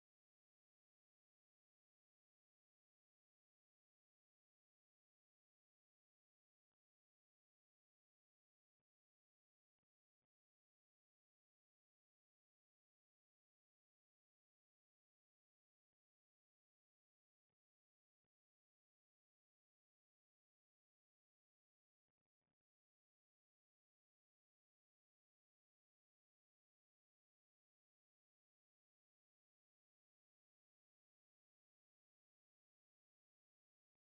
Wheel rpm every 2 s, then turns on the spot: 0, 0, 0, 0, 0, 0, 0, 0, 0, 0, 0, 0, 0, 0, 0, 0, 0.
none